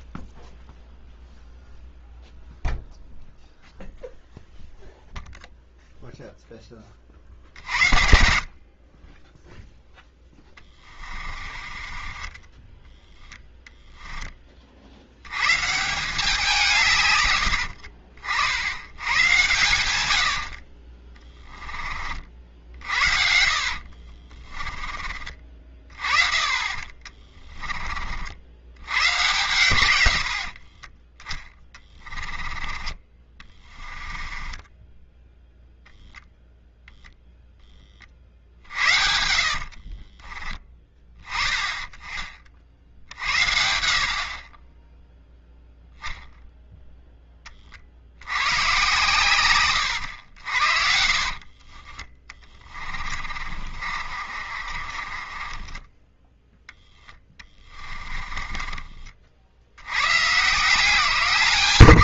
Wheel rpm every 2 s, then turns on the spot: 0, 0, 0, 20, 40, 30, 10, 70, 140, 100, 30, 60, 30, 40, 80, 40, 20, 10, 0, 60, 10, 60, 20, 0, 110, 60, 30, 40, 10, 30, 160.
10-14 22-24 26-28 30-32 34-36 38-40 50-56 58-60